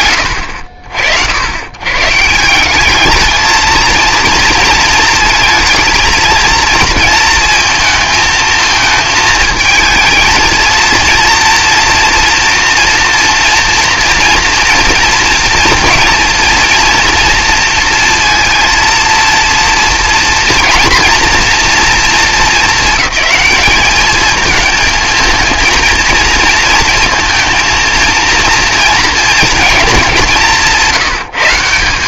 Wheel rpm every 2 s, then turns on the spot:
70, 210, 220, 230, 220, 230, 230, 230, 230, 230, 240, 220, 220, 230, 230, 190.
none